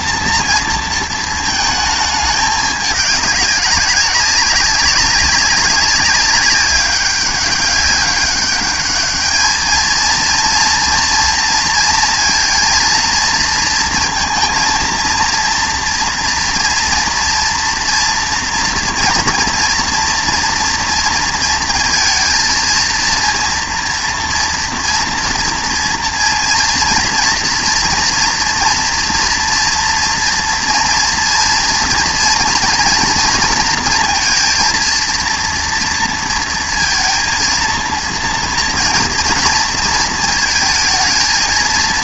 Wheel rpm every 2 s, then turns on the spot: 230, 210, 190, 190, 200, 230, 230, 230, 240, 240, 230, 230, 230, 230, 230, 230, 230, 230, 230, 230, 220.
none